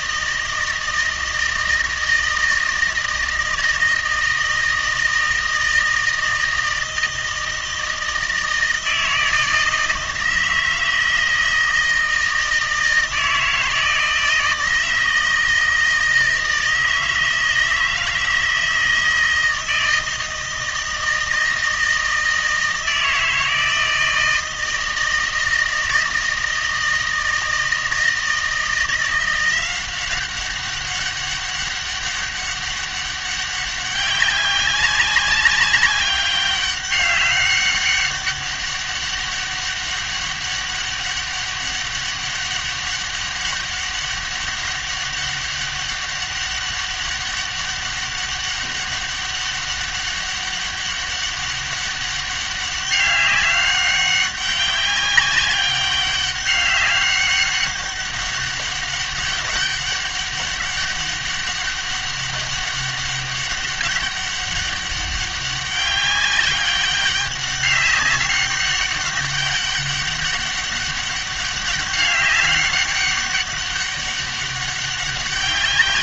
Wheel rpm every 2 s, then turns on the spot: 160, 160, 160, 160, 160, 160, 160, 160, 160, 160, 160, 160, 160, 160, 160, 190, 200, 190, 190, 200, 200, 200, 200, 200, 200, 200, 200, 200, 200, 200, 200, 200, 200, 200, 200, 200, 200, 200.
none